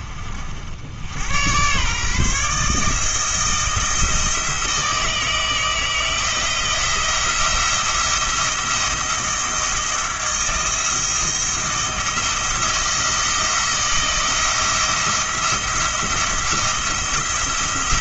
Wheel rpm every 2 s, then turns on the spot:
80, 160, 160, 170, 170, 160, 170, 170, 170.
none